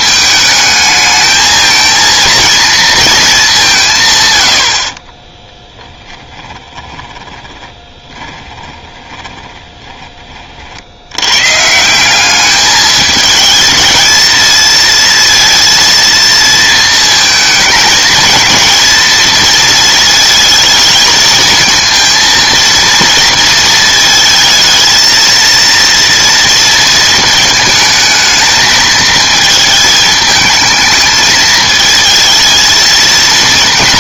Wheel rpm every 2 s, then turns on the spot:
220, 230, 60, 20, 10, 50, 210, 230, 230, 230, 220, 230, 220, 230, 220, 220, 220.
6-10